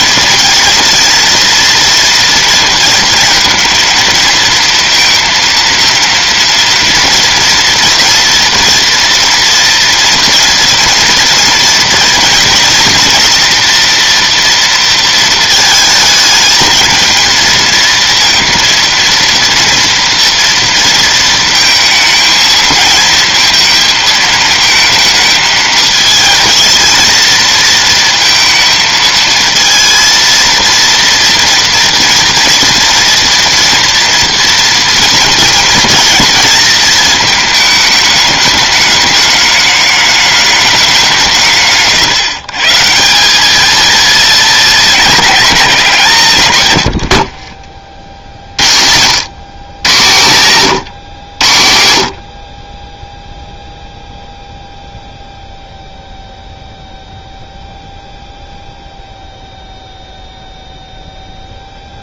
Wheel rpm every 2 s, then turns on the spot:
230, 230, 230, 230, 230, 230, 230, 230, 220, 230, 230, 220, 220, 230, 220, 230, 230, 230, 230, 220, 210, 150, 220, 130, 70, 120, 40, 0, 0, 0, 0.
none